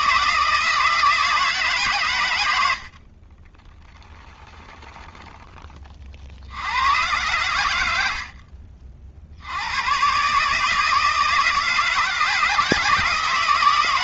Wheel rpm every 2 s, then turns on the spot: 160, 60, 0, 100, 50, 160, 160.
none